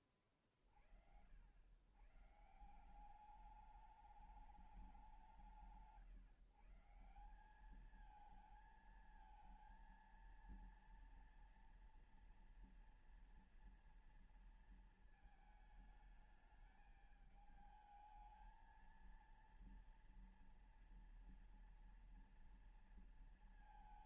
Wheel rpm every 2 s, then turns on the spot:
80, 210, 150, 200, 230, 230, 230, 220, 220, 230, 230, 210.
none